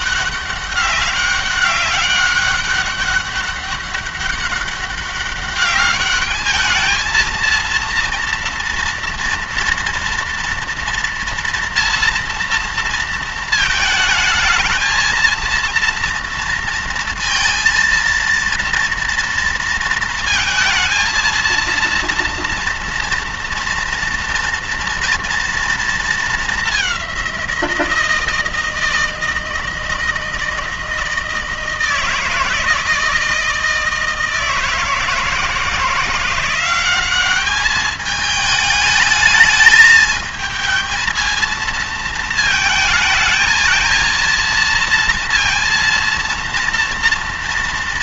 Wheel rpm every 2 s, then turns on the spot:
200, 200, 200, 220, 230, 230, 230, 220, 230, 230, 220, 240, 230, 200, 160, 160, 160, 160, 190, 220, 220, 220, 230, 240.
none